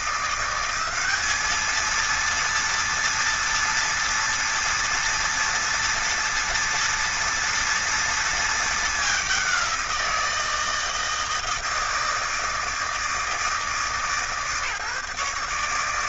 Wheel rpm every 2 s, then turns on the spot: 180, 230, 230, 230, 230, 170, 160, 150.
none